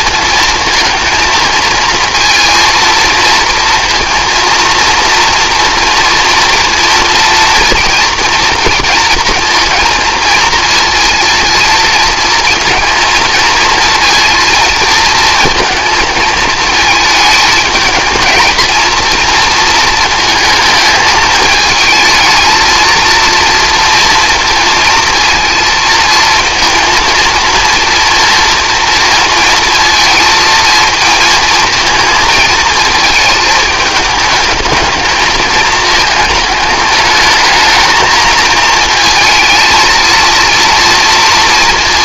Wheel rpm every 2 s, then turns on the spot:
230, 230, 230, 230, 230, 230, 220, 230, 220, 230, 220, 230, 230, 230, 230, 220, 220, 220, 210, 220, 230.
none